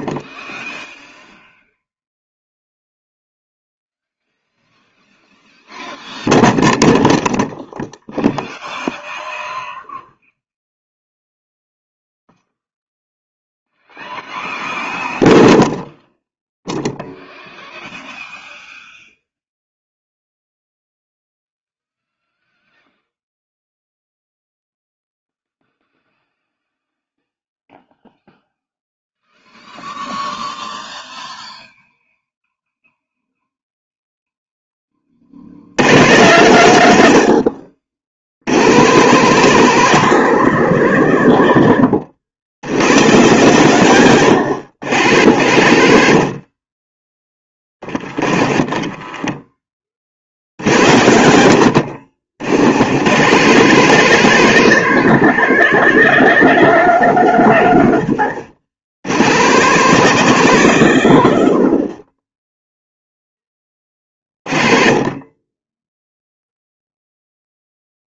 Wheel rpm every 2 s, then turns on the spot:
0, 0, 0, 0, 0, 0, 0, 0, 0, 0, 0, 0, 0, 0, 0, 0, 0, 10, 110, 110, 160, 110, 120, 30, 20, 70, 90, 170, 190, 100, 150, 10, 30, 0.
none